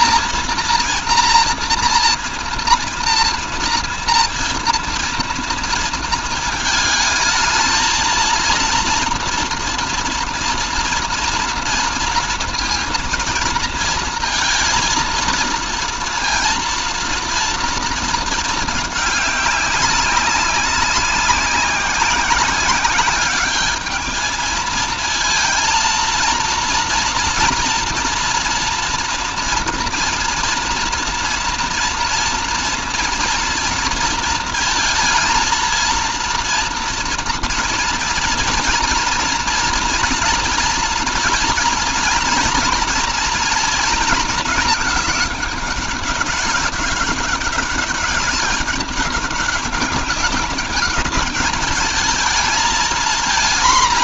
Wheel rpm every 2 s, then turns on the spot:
230, 230, 230, 220, 230, 240, 230, 230, 230, 220, 200, 200, 220, 230, 240, 240, 230, 230, 230, 230, 230, 230, 220, 200, 200, 200, 220.
none